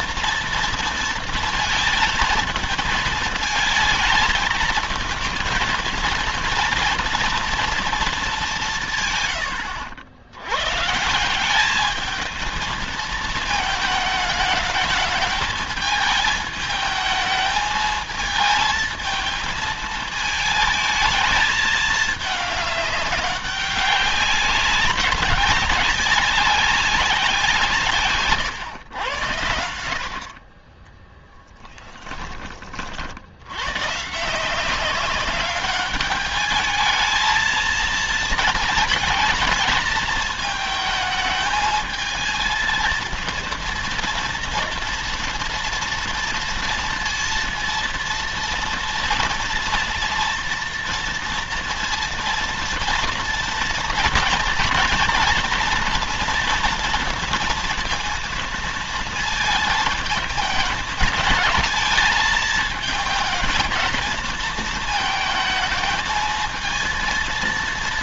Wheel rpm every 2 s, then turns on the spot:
230, 220, 220, 230, 180, 130, 220, 220, 220, 220, 220, 210, 190, 190, 120, 20, 30, 170, 210, 220, 220, 230, 230, 230, 230, 230, 230, 230, 230, 230, 220, 220, 220, 230.
30-32